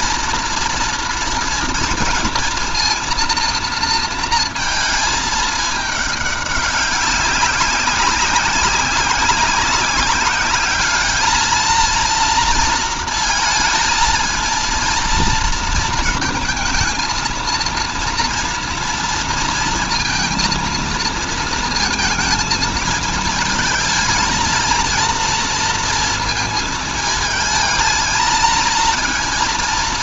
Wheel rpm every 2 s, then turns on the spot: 230, 230, 220, 200, 190, 210, 230, 230, 220, 230, 230, 220, 230, 220, 230.
none